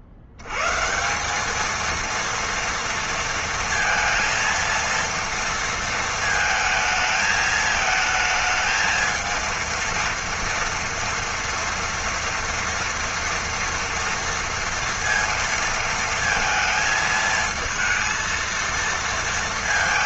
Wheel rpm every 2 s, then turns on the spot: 80, 230, 230, 220, 220, 230, 230, 230, 230, 230.
none